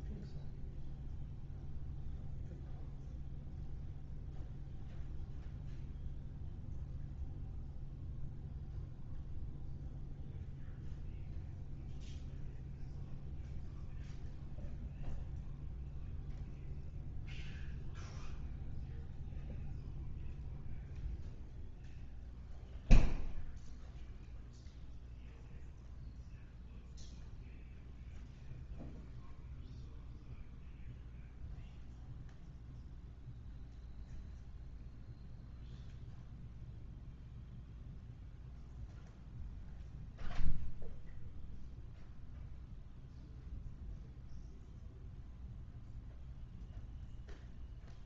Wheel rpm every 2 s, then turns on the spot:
0, 0, 0, 0, 0, 0, 0, 0, 0, 0, 0, 0, 0, 0, 0, 0, 0, 0, 0, 0, 0, 0, 0, 0.
none